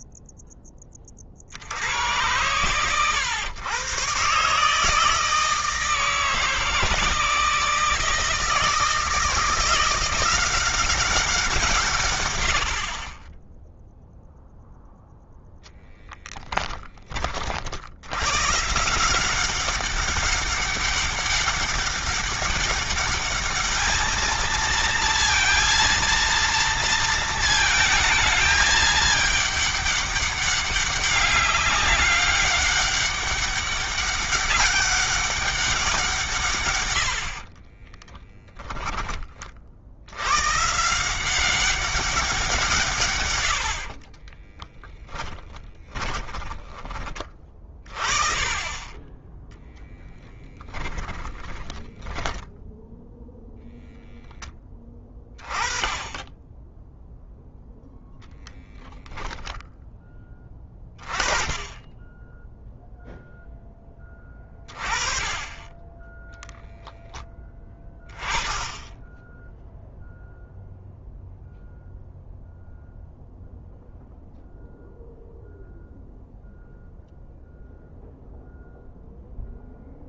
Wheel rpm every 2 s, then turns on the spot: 30, 120, 150, 160, 160, 190, 70, 0, 20, 160, 200, 200, 230, 230, 210, 200, 200, 200, 100, 20, 160, 150, 10, 30, 20, 10, 0, 10, 10, 0, 20, 0, 30, 10, 10, 0, 0, 0, 0, 0.
50-52